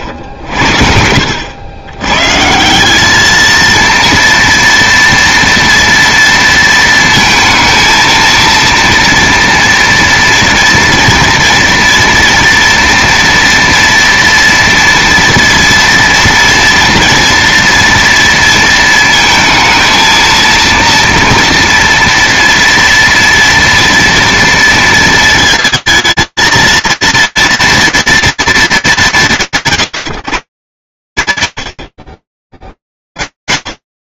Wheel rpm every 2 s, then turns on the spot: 70, 170, 230, 230, 230, 240, 230, 230, 240, 230, 230, 230, 230, 230, 190, 110, 30.
none